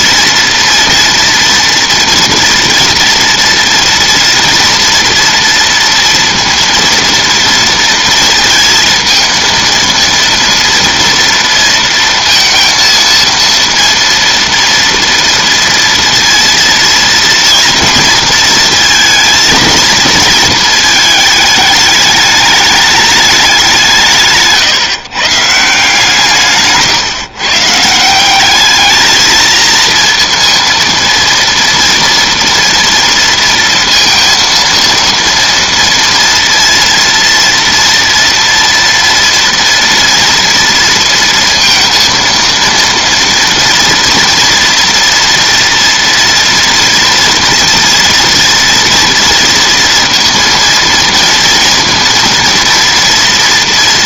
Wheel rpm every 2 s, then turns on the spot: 230, 230, 230, 230, 230, 230, 230, 230, 230, 230, 220, 210, 150, 150, 210, 230, 240, 230, 230, 230, 230, 230, 230, 230, 230, 230, 230.
none